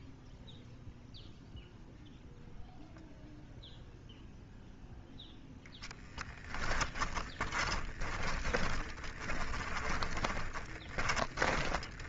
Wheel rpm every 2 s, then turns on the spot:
0, 0, 0, 10, 20, 20.
6-12